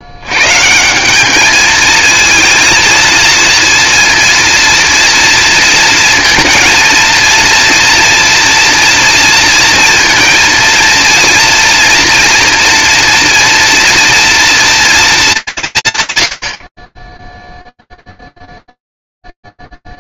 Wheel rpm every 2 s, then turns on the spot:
150, 230, 240, 230, 230, 230, 230, 240, 70, 0.
none